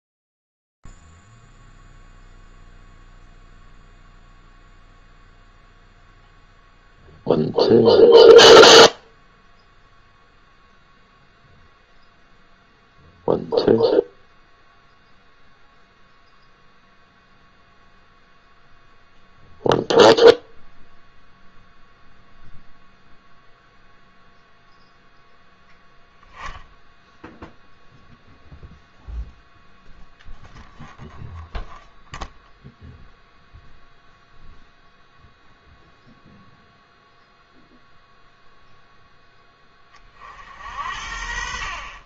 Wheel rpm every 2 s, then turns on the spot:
0, 0, 0, 0, 0, 0, 0, 0, 0, 0, 0, 0, 0, 0, 0, 0, 0, 0, 0, 0, 70.
none